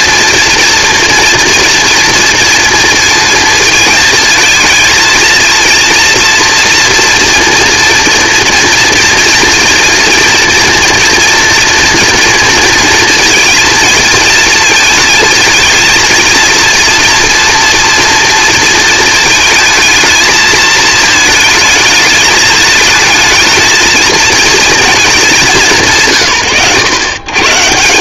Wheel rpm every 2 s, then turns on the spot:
230, 230, 220, 230, 240, 230, 230, 220, 230, 220, 220, 220, 230, 100.
none